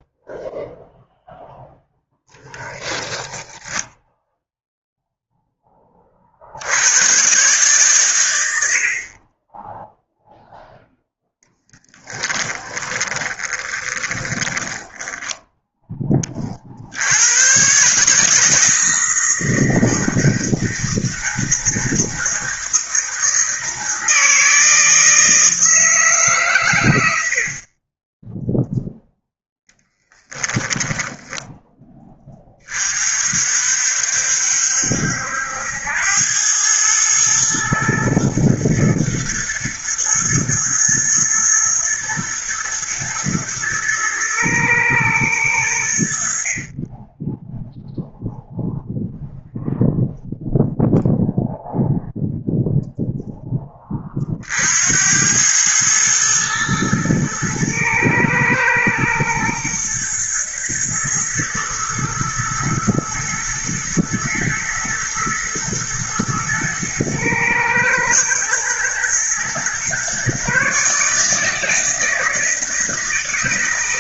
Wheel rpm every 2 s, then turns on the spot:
0, 20, 0, 110, 60, 0, 20, 10, 70, 160, 160, 160, 160, 100, 0, 20, 40, 70, 110, 110, 110, 120, 110, 20, 0, 0, 0, 80, 110, 110, 120, 110, 110, 110, 120, 150, 160.
2-4 12-16 30-32